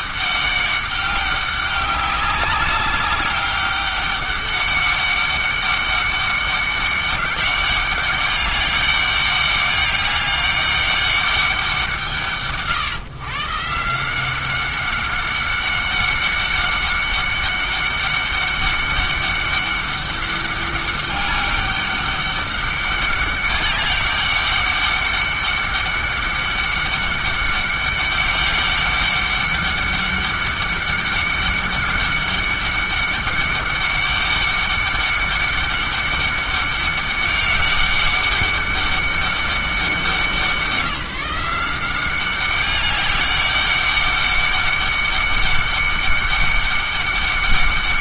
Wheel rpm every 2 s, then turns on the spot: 200, 200, 200, 200, 200, 200, 140, 190, 200, 200, 200, 200, 200, 200, 200, 200, 200, 200, 200, 200, 180, 200, 200, 200.
none